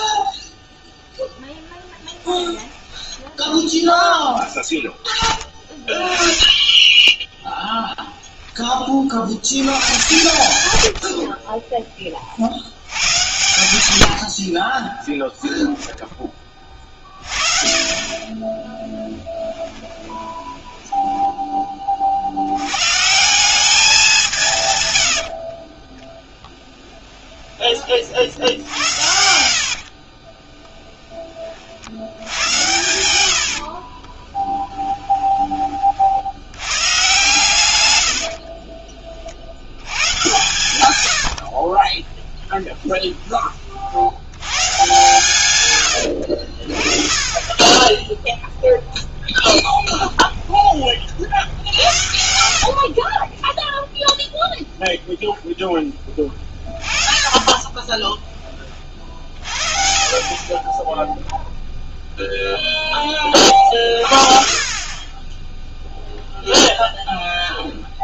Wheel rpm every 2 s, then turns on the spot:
0, 20, 0, 10, 20, 100, 90, 40, 40, 30, 10, 160, 80, 20, 70, 50, 70, 30, 130, 70, 70, 30, 110, 30, 10, 60, 10, 0, 30, 40, 0, 20, 20, 0.
2-4 14-16 18-22 24-26 28-30 32-34 40-42 48-50 56-58